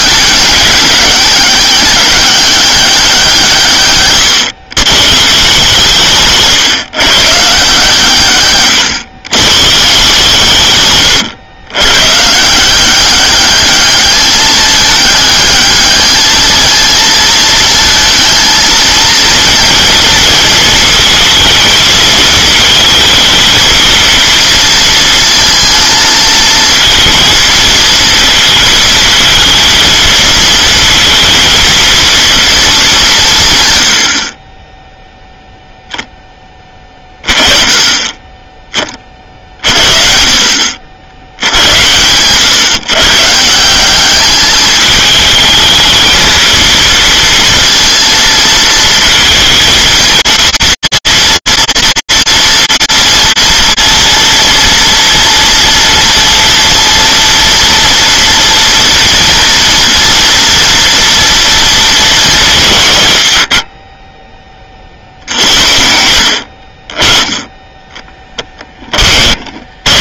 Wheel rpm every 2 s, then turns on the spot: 200, 200, 120, 140, 120, 130, 170, 210, 220, 220, 230, 220, 230, 220, 230, 230, 220, 20, 10, 20, 80, 130, 210, 230, 230, 230, 230, 230, 230, 230, 230, 160, 40, 50, 10.
8-10 66-70